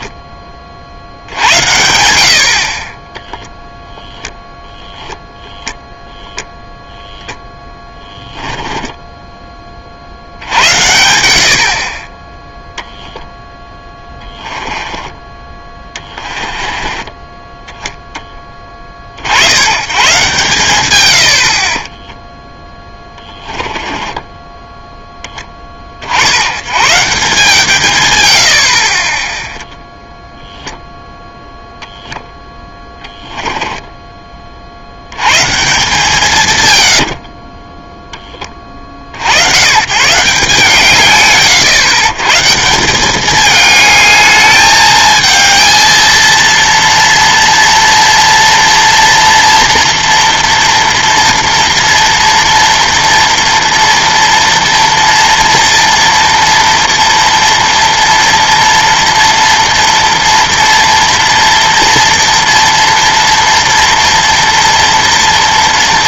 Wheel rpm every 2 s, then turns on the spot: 30, 30, 0, 0, 10, 80, 10, 10, 20, 20, 130, 10, 10, 100, 70, 0, 10, 50, 130, 30, 150, 160, 210, 230, 230, 230, 230, 230, 230, 230, 230, 230, 230.
8-10 14-18 22-26 32-34 36-38